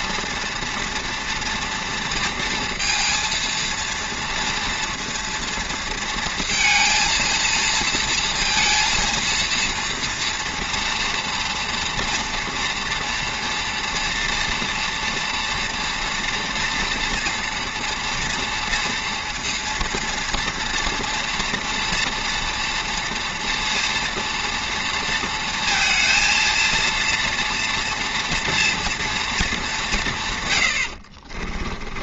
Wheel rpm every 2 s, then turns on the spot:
230, 230, 230, 230, 230, 230, 230, 230, 230, 230, 240, 230, 230, 230, 240, 100.
none